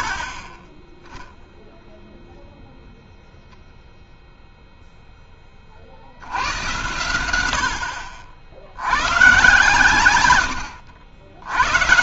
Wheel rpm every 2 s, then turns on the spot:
20, 0, 0, 80, 110, 90.
none